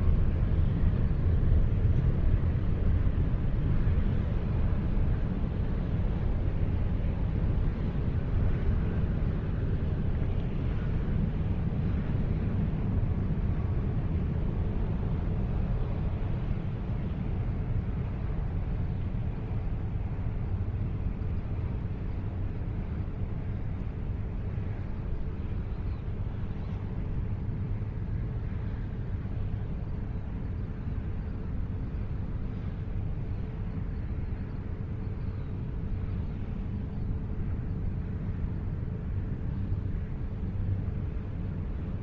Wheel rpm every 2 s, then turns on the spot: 0, 0, 0, 0, 0, 0, 0, 0, 0, 0, 0, 0, 0, 0, 0, 0, 0, 0, 0, 0, 0.
none